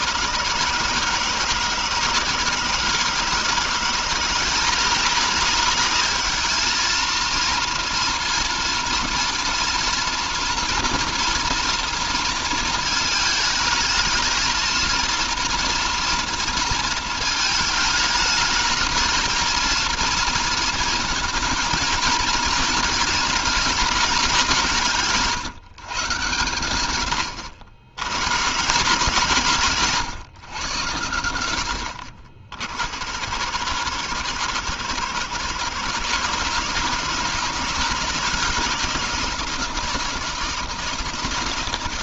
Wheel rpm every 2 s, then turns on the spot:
160, 160, 190, 230, 240, 230, 220, 230, 230, 220, 220, 220, 160, 100, 150, 100, 80, 120, 160, 170, 160.
none